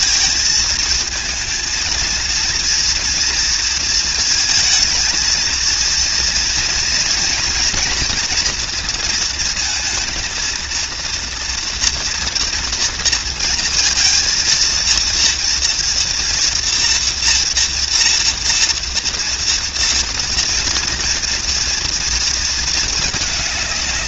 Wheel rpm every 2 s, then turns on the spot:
220, 230, 230, 240, 230, 230, 230, 230, 240, 230, 230, 220.
none